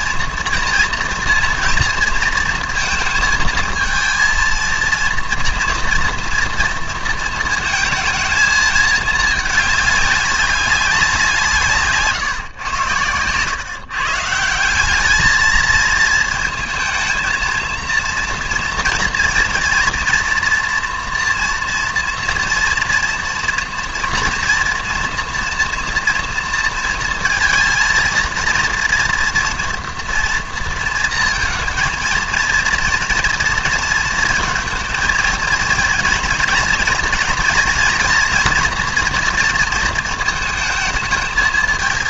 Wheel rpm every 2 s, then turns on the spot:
230, 230, 230, 230, 220, 200, 120, 180, 220, 230, 230, 230, 240, 230, 230, 230, 230, 220, 230, 230, 220.
none